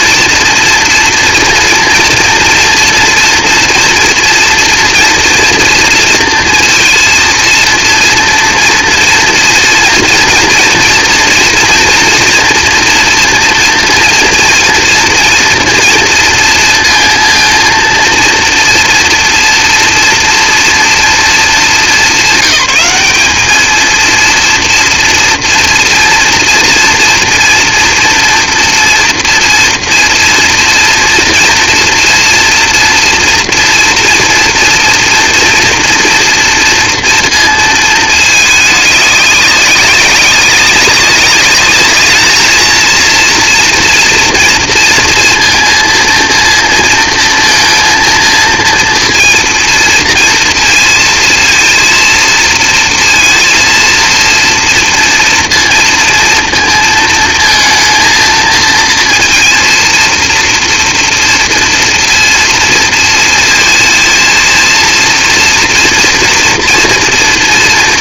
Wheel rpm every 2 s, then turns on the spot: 230, 230, 230, 230, 230, 230, 240, 230, 230, 230, 230, 200, 230, 230, 230, 230, 230, 230, 230, 210, 200, 230, 230, 230, 230, 230, 230, 230, 230, 230, 230, 230, 230, 230.
none